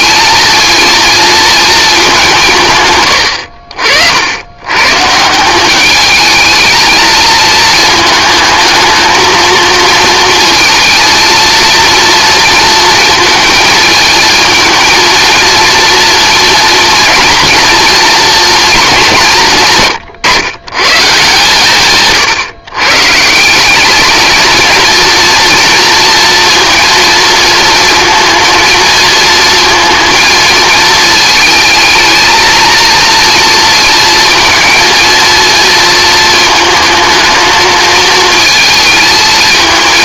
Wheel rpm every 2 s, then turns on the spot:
230, 150, 110, 220, 220, 230, 230, 230, 230, 220, 130, 130, 230, 230, 230, 220, 220, 230, 220, 220.
none